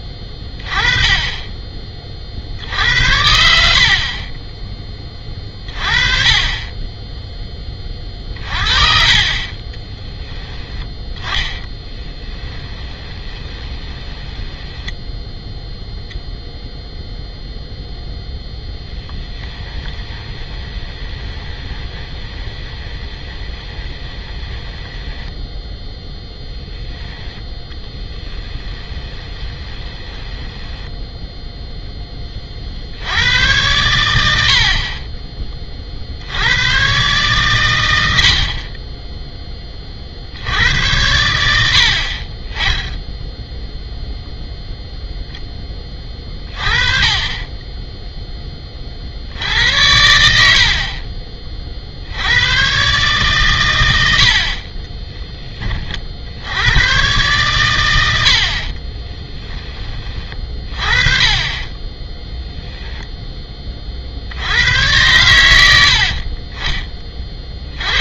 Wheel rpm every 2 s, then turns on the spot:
20, 70, 20, 20, 30, 10, 10, 10, 0, 10, 20, 20, 10, 10, 10, 10, 50, 50, 100, 40, 80, 20, 0, 30, 20, 60, 130, 30, 100, 40, 30, 0, 100, 30.
8-16 18-26 28-32